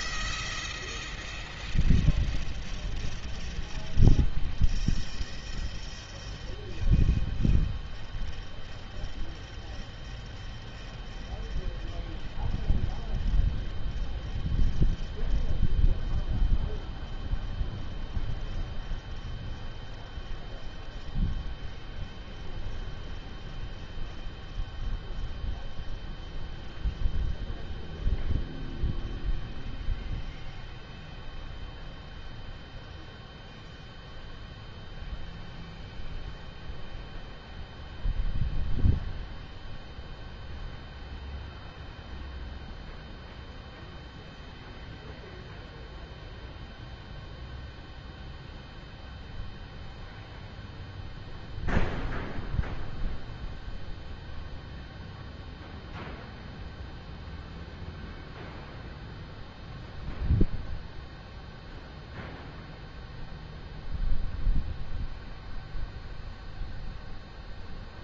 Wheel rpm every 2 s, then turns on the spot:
0, 0, 0, 0, 0, 0, 0, 0, 0, 0, 0, 0, 0, 0, 0, 0, 0, 0, 0, 0, 0, 0, 0, 0, 0, 0, 0, 0, 0, 0, 0, 0, 0, 0.
none